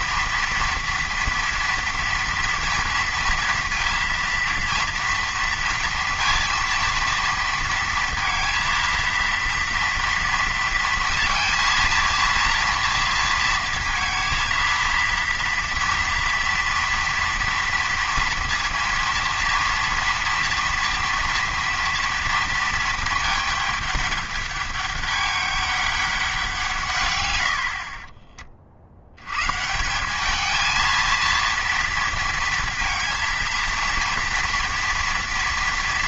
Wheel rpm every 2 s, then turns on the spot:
240, 230, 230, 230, 230, 230, 230, 230, 230, 230, 230, 220, 200, 160, 50, 220, 230, 230.
none